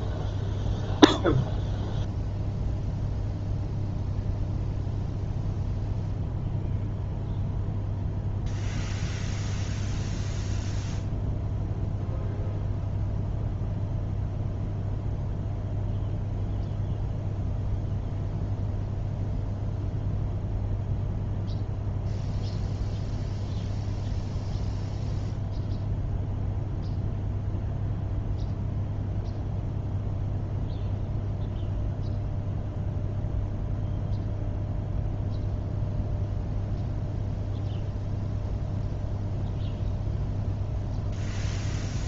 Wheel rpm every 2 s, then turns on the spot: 0, 0, 0, 0, 0, 0, 0, 0, 0, 0, 0, 0, 0, 0, 0, 0, 0, 0, 0, 0, 0.
none